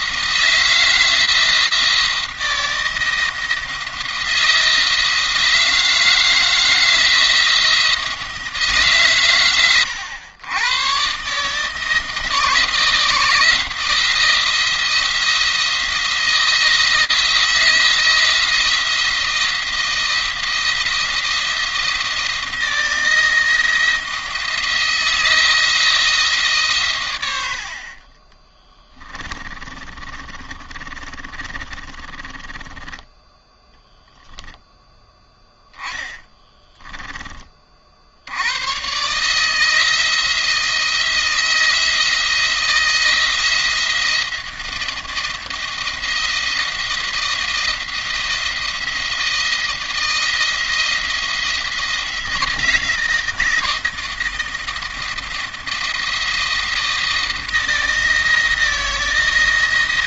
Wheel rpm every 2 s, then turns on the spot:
170, 170, 160, 160, 140, 120, 160, 170, 170, 170, 170, 160, 160, 130, 20, 30, 20, 10, 10, 130, 170, 160, 170, 170, 170, 160, 170, 170, 170, 160.
28-34